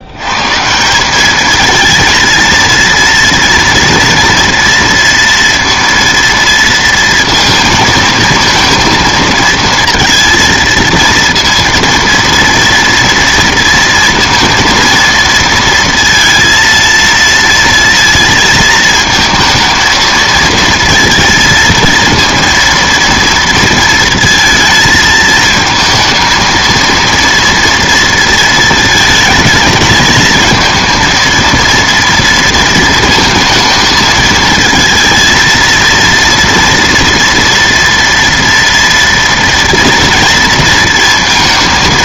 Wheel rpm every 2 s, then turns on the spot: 160, 230, 230, 230, 230, 230, 230, 230, 230, 230, 230, 230, 220, 230, 230, 220, 230, 220, 240, 230, 230.
none